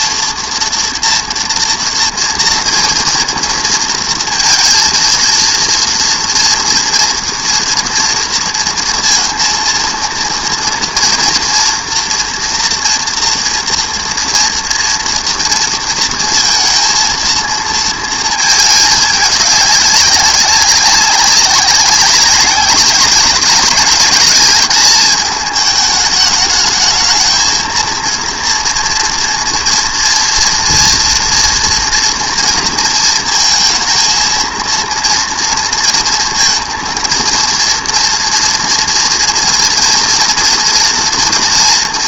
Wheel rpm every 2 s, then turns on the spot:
230, 230, 230, 230, 230, 230, 230, 230, 230, 220, 190, 190, 210, 220, 230, 230, 230, 230, 220, 230, 240.
none